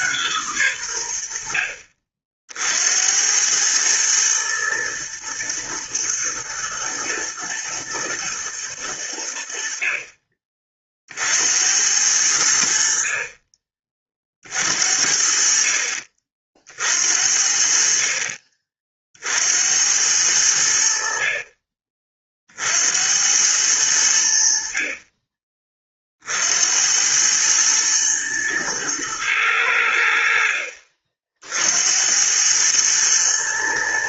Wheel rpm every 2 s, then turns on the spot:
130, 60, 110, 110, 110, 40, 80, 40, 50, 40, 80, 50, 60, 70, 110, 50, 100.
none